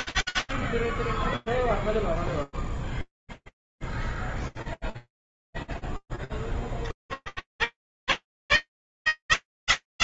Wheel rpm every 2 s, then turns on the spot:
0, 30, 70, 190, 200.
none